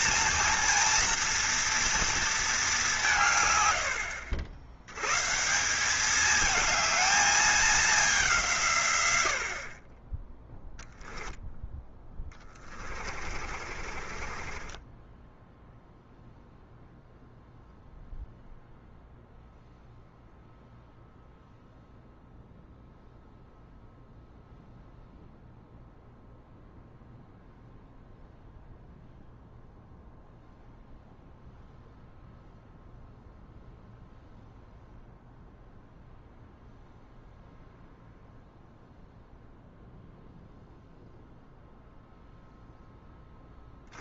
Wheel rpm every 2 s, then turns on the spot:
230, 190, 110, 220, 120, 0, 40, 20, 0, 0, 0, 0, 0, 0, 0, 0, 0, 0, 0, 0, 0, 10.
12-16